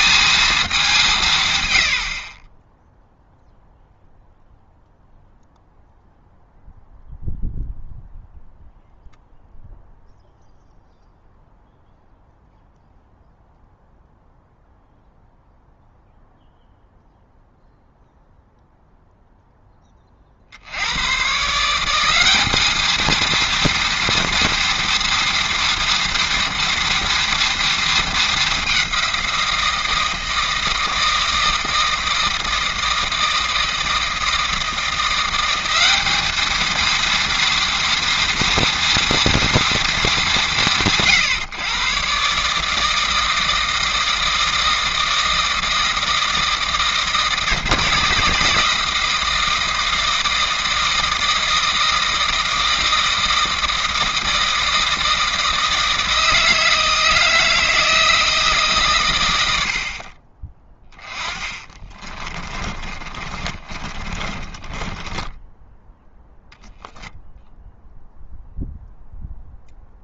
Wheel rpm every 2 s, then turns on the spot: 200, 10, 0, 0, 0, 0, 0, 0, 0, 0, 80, 220, 230, 230, 190, 160, 160, 170, 230, 230, 140, 160, 160, 160, 160, 160, 160, 160, 160, 150, 20, 30, 20, 0, 0.
62-66